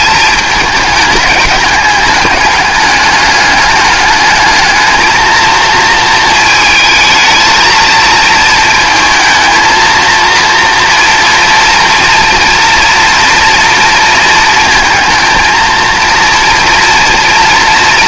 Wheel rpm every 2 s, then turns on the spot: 210, 200, 220, 220, 230, 230, 240, 230, 230.
none